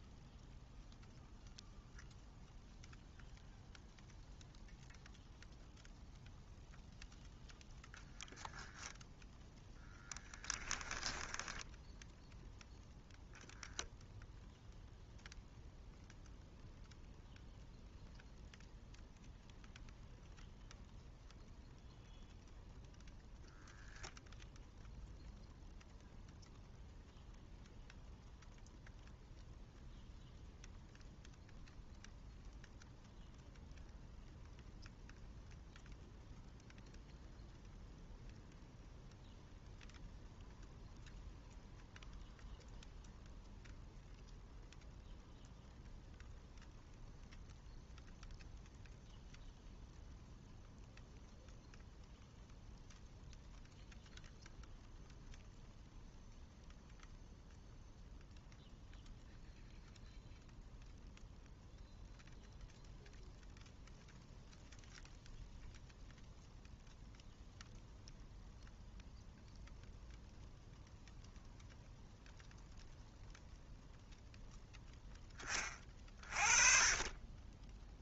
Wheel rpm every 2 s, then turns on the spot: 0, 0, 0, 0, 10, 10, 0, 0, 0, 0, 0, 0, 0, 0, 0, 0, 0, 0, 0, 0, 0, 0, 0, 0, 0, 0, 0, 0, 0, 0, 0, 0, 0, 0, 0, 0, 0, 10, 30.
10-12